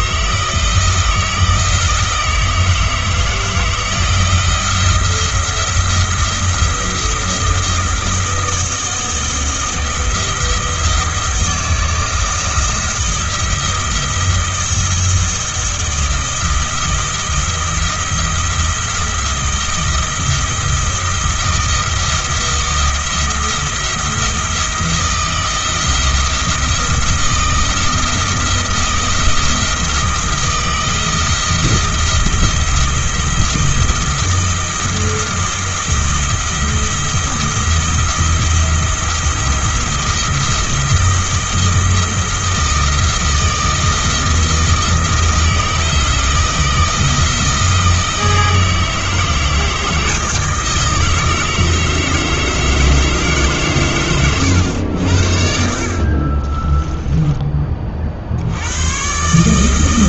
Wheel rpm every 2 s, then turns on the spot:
160, 160, 170, 170, 160, 170, 170, 170, 170, 170, 170, 170, 170, 170, 170, 170, 170, 170, 170, 170, 170, 160, 160, 160, 160, 160, 160, 80, 10, 120.
none